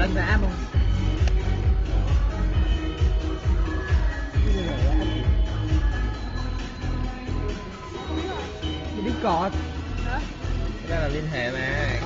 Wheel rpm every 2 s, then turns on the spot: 0, 0, 0, 0, 0, 0.
none